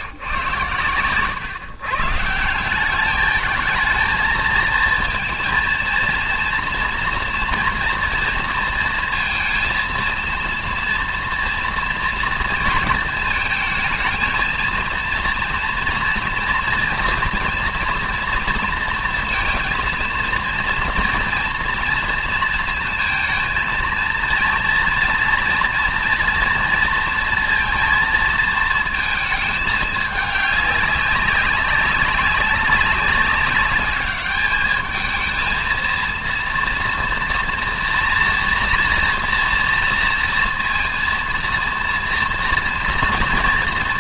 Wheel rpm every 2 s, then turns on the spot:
110, 190, 230, 230, 230, 230, 230, 230, 230, 230, 230, 230, 230, 230, 230, 200, 200, 210, 230, 240, 230, 230.
none